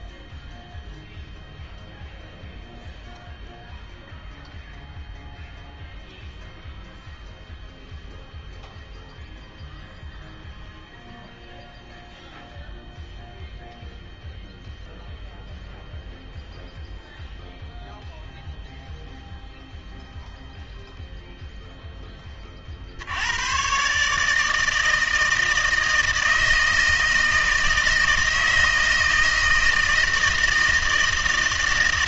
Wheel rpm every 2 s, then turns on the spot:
0, 0, 0, 0, 0, 0, 0, 0, 0, 0, 0, 40, 160, 160, 160, 160.
none